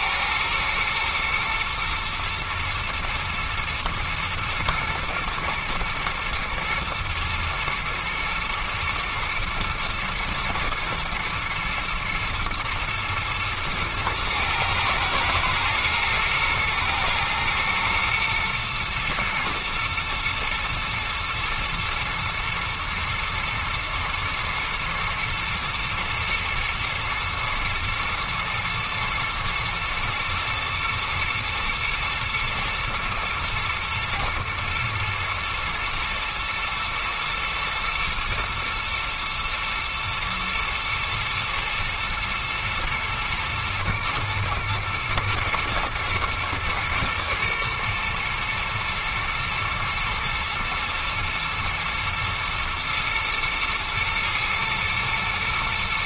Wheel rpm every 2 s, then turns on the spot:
110, 120, 110, 110, 110, 120, 110, 110, 110, 110, 110, 120, 110, 110, 110, 110, 120, 120, 110, 110, 120, 110, 110, 110, 120, 120, 120, 110.
none